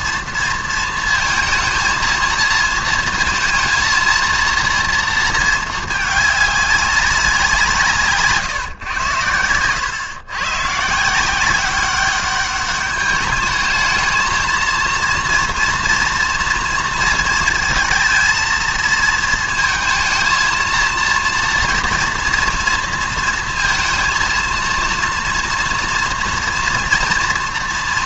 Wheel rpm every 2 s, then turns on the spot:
230, 220, 230, 210, 120, 140, 200, 230, 230, 220, 230, 230, 230, 230.
none